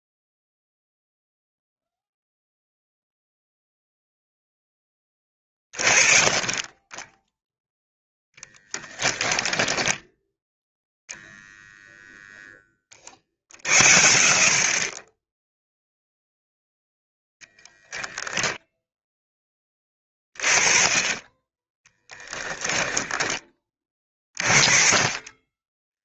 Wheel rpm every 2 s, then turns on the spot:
0, 0, 10, 10, 20, 0, 20, 50, 0, 0, 20, 10, 30.
8-10 22-24